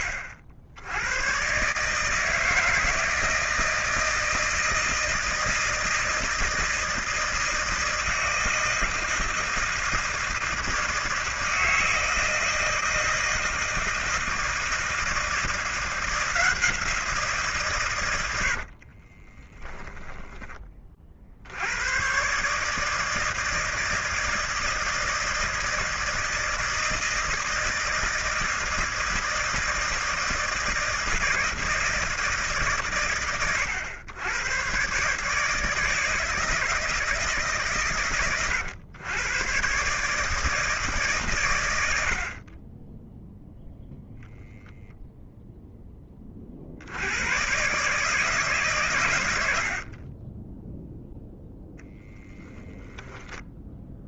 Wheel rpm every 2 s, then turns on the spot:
70, 160, 160, 160, 160, 160, 160, 160, 170, 40, 40, 150, 160, 160, 160, 160, 130, 130, 160, 110, 150, 20, 0, 60, 120, 0, 0.
18-20